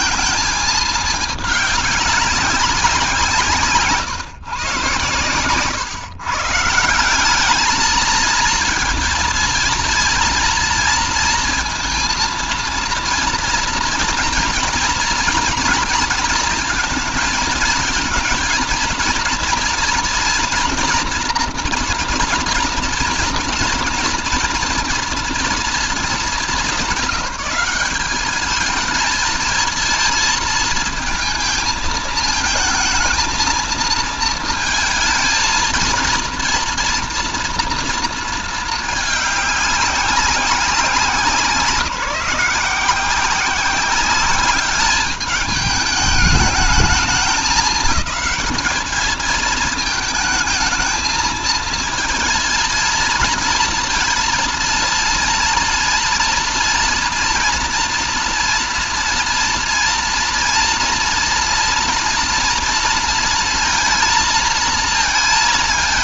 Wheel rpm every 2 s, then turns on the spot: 220, 190, 120, 170, 230, 230, 230, 240, 230, 220, 230, 230, 230, 190, 210, 220, 230, 220, 230, 220, 190, 180, 200, 220, 210, 220, 230, 230, 230, 230, 230, 230, 230.
none